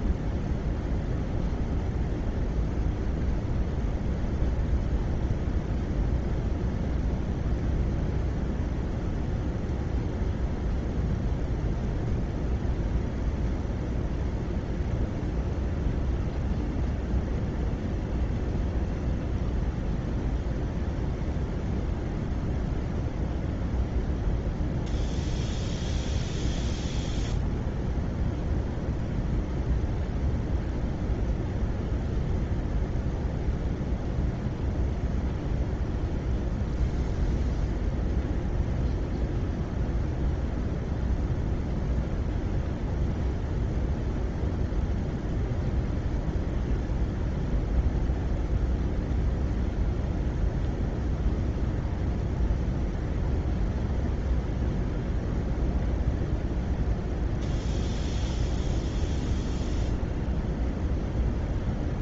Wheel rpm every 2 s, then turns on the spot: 0, 0, 0, 0, 0, 0, 0, 0, 0, 0, 0, 0, 0, 0, 0, 0, 0, 0, 0, 0, 0, 0, 0, 0, 0, 0, 0, 0, 0, 0, 0.
none